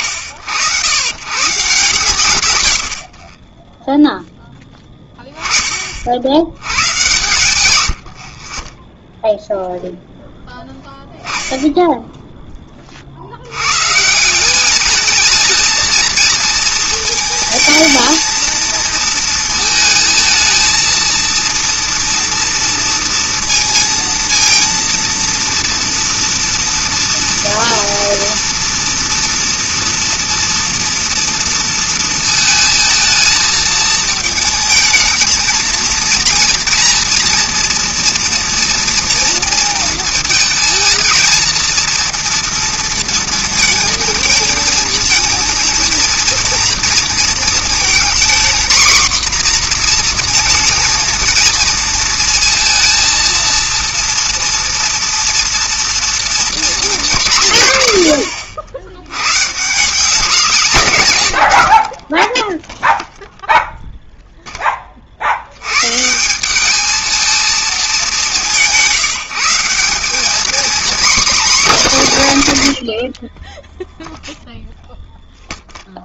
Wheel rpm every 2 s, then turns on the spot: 90, 90, 10, 110, 30, 10, 20, 200, 220, 220, 230, 230, 230, 230, 230, 240, 220, 220, 230, 230, 230, 230, 230, 230, 240, 230, 230, 230, 220, 80, 190, 0, 20, 210, 180, 250, 160, 0.
10-12